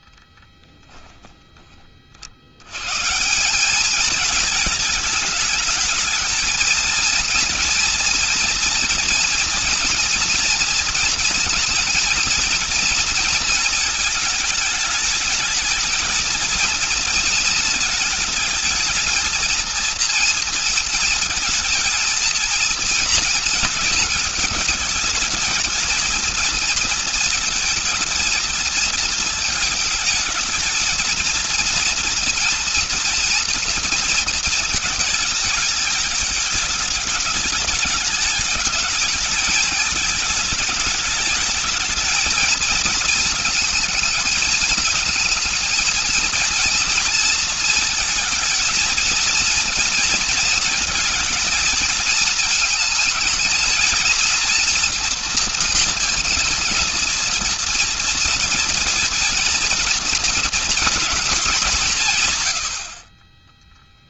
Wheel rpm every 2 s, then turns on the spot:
10, 80, 220, 220, 230, 230, 230, 220, 220, 220, 230, 230, 220, 230, 230, 220, 230, 220, 210, 210, 210, 230, 220, 230, 230, 230, 220, 230, 230, 230, 240, 130.
0-2